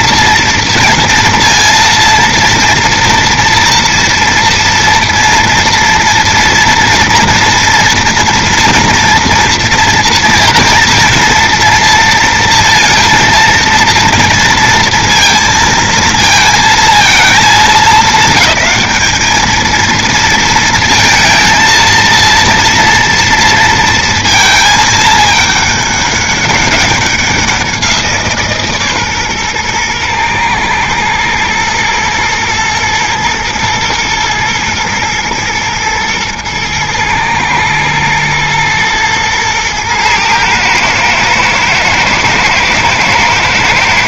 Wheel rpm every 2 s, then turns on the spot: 230, 230, 230, 230, 230, 230, 230, 230, 230, 200, 230, 230, 230, 200, 170, 120, 120, 120, 120, 120, 120, 120.
none